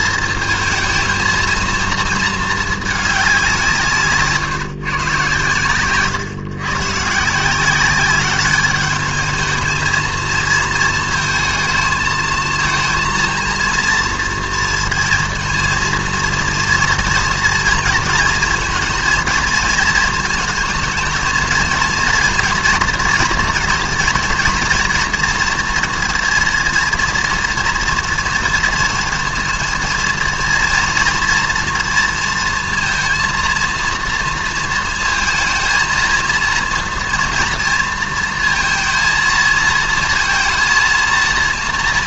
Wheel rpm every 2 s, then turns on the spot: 220, 230, 150, 130, 200, 220, 230, 230, 230, 230, 220, 230, 230, 230, 230, 230, 230, 230, 230, 230, 230.
none